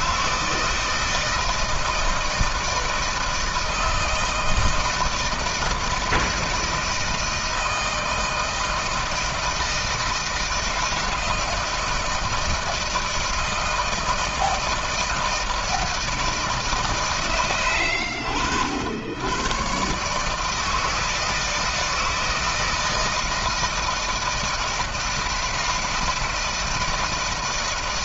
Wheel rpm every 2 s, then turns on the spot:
160, 160, 160, 160, 160, 160, 160, 160, 140, 70, 160, 160, 160, 160.
none